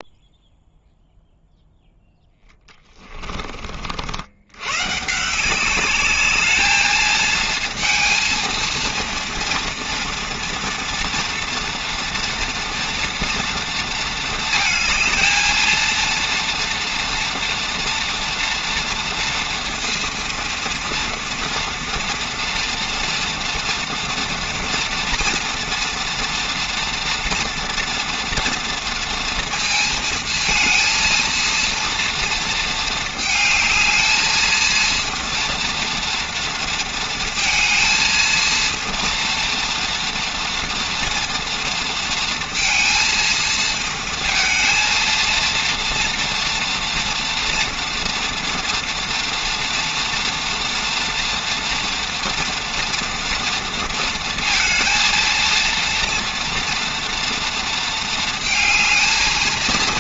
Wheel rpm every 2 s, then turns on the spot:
0, 10, 120, 210, 230, 230, 230, 220, 230, 230, 230, 230, 230, 230, 230, 230, 230, 230, 230, 230, 240, 230, 230, 230, 230, 240, 230, 230, 230, 220.
2-4